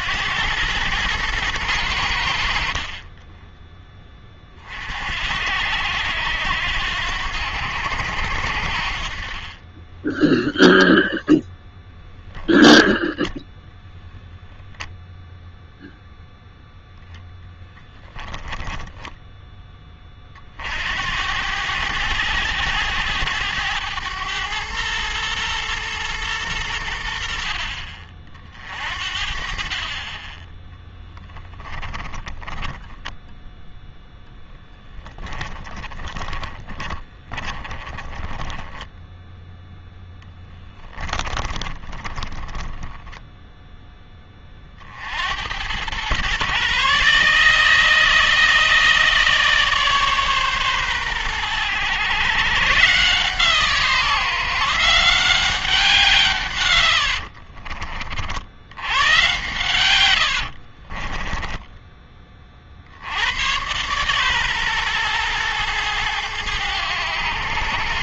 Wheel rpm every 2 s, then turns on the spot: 100, 50, 50, 80, 60, 0, 10, 0, 0, 10, 60, 100, 110, 90, 50, 10, 20, 10, 30, 10, 10, 10, 40, 140, 160, 130, 130, 160, 100, 90, 40, 40, 130, 100.
12-14 30-34 36-44 56-58 60-62